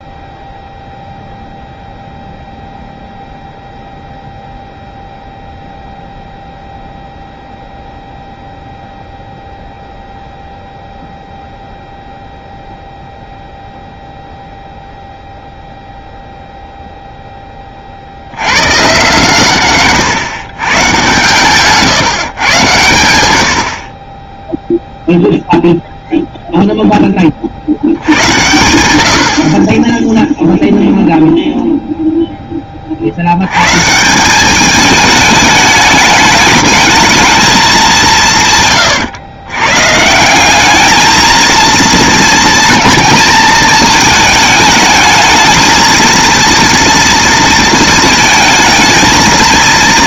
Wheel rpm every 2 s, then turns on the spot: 0, 0, 0, 0, 0, 0, 0, 0, 0, 110, 130, 120, 0, 0, 90, 0, 30, 210, 220, 130, 210, 230, 220, 230, 220.
none